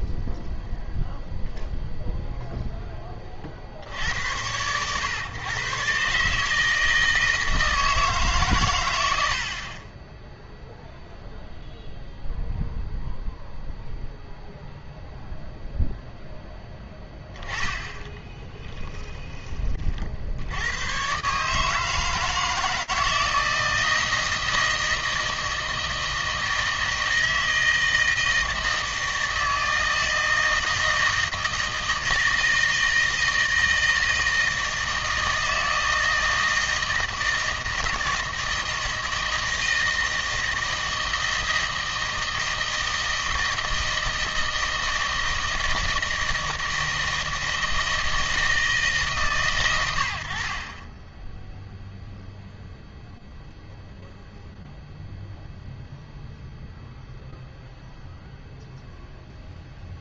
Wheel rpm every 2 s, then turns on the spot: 0, 0, 100, 160, 110, 0, 0, 0, 10, 10, 90, 160, 160, 160, 160, 160, 160, 160, 160, 160, 160, 160, 160, 160, 160, 50, 0, 0, 0, 0.
18-20